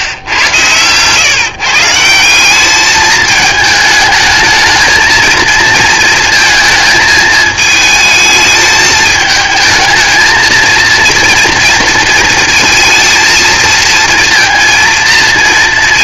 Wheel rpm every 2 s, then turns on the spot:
120, 210, 220, 220, 220, 230, 230, 230.
none